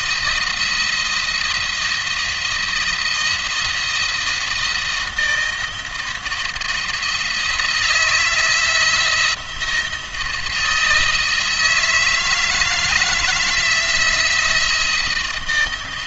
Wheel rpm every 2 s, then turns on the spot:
170, 170, 170, 170, 170, 160, 160, 170.
none